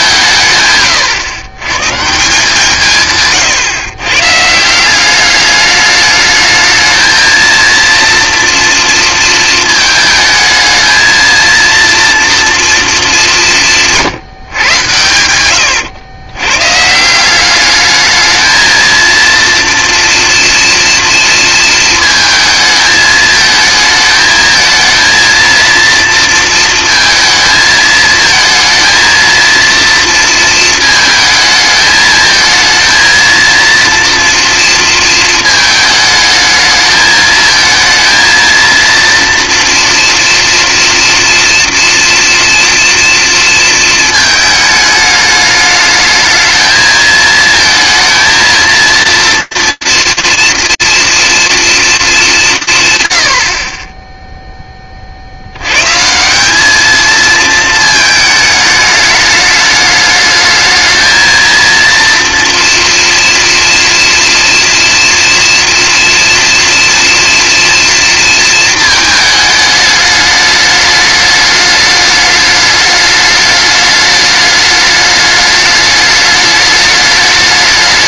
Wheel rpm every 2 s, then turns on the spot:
140, 150, 180, 220, 230, 220, 230, 110, 110, 230, 230, 220, 220, 230, 230, 220, 220, 230, 210, 230, 230, 230, 210, 220, 230, 230, 150, 10, 200, 210, 220, 230, 230, 230, 230, 210, 210, 210, 210.
0-2